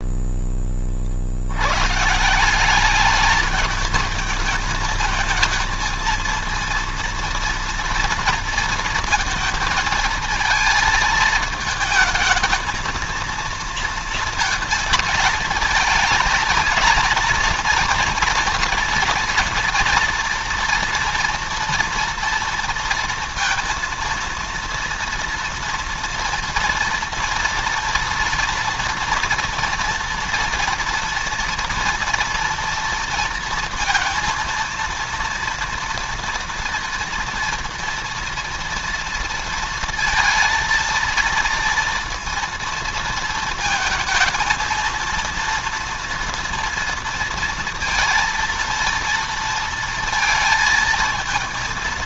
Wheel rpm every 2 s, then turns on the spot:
20, 190, 220, 230, 230, 220, 230, 230, 230, 230, 230, 230, 230, 230, 240, 240, 230, 230, 230, 240, 230, 230, 230, 230, 230, 230.
none